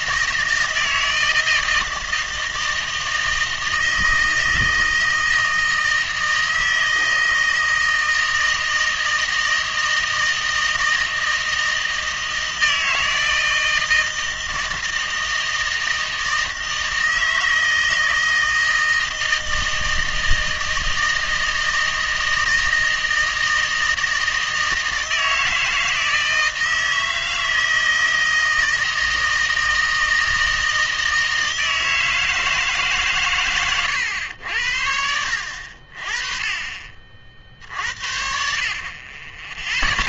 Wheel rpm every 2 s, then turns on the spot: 160, 160, 160, 160, 160, 160, 160, 160, 160, 160, 160, 160, 160, 160, 160, 160, 160, 80, 30, 60.
none